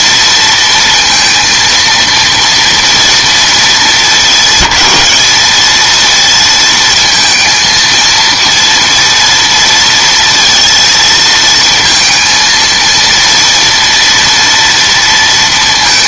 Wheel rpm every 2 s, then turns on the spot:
230, 230, 210, 230, 230, 230, 230, 230.
none